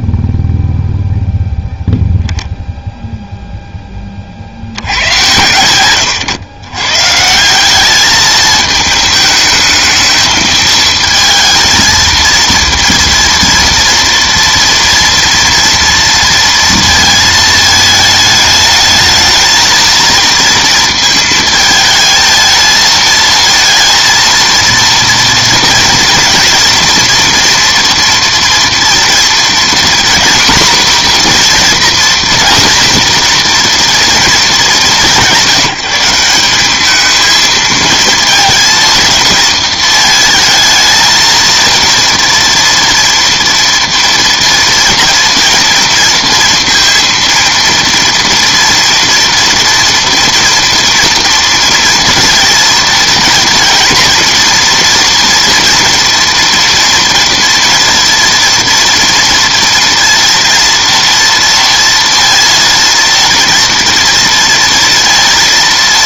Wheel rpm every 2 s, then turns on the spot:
0, 0, 90, 130, 220, 220, 230, 230, 230, 220, 230, 220, 230, 230, 240, 240, 240, 180, 210, 230, 220, 240, 230, 230, 230, 240, 230, 230, 230, 230, 230, 230, 230.
none